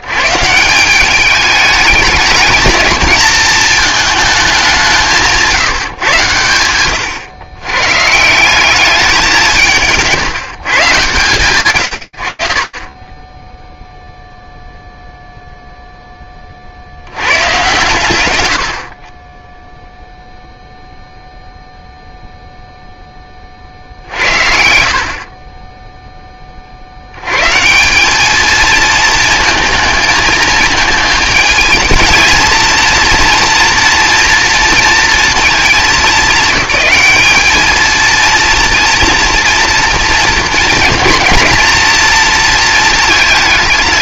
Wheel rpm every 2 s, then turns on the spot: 160, 220, 200, 110, 200, 160, 40, 0, 60, 60, 0, 0, 50, 80, 220, 220, 230, 230, 200, 230, 230, 220.
none